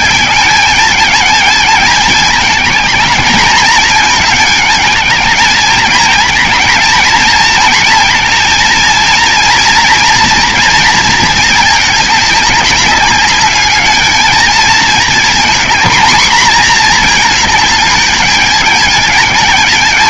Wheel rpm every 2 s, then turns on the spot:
210, 220, 220, 220, 230, 240, 210, 220, 230, 220.
none